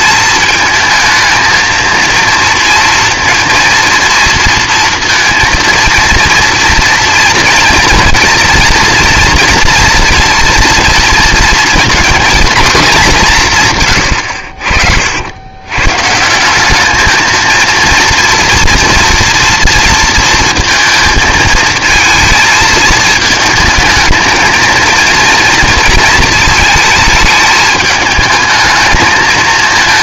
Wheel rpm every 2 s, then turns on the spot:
220, 230, 230, 230, 230, 230, 230, 70, 200, 230, 230, 220, 230, 230, 220.
none